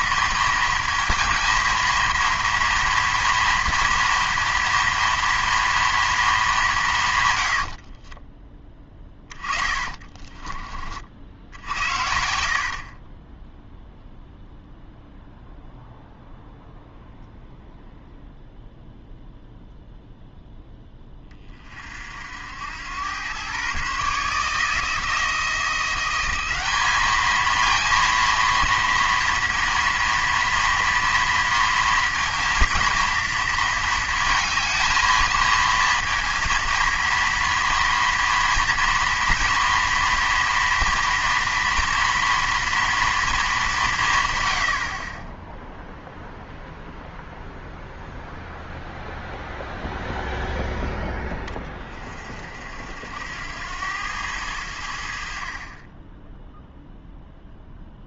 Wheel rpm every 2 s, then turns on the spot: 220, 230, 230, 200, 30, 40, 60, 0, 0, 0, 10, 80, 150, 190, 230, 230, 230, 230, 230, 230, 230, 240, 100, 0, 0, 0, 60, 90, 0.
8-10 12-14